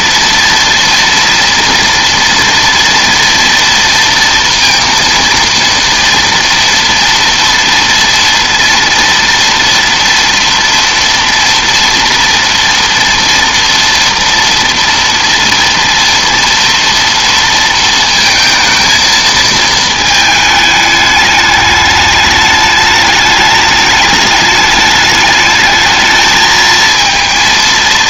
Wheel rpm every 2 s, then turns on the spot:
240, 230, 230, 230, 230, 230, 230, 230, 230, 230, 210, 210, 210, 220.
none